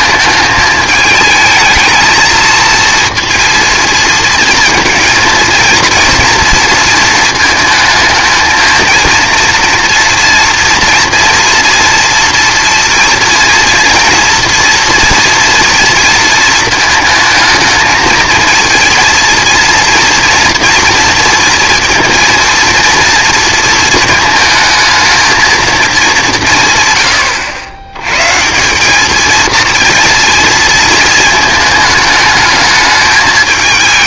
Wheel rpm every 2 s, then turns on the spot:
210, 230, 230, 230, 230, 240, 240, 230, 220, 230, 230, 230, 220, 150, 190, 230, 220.
none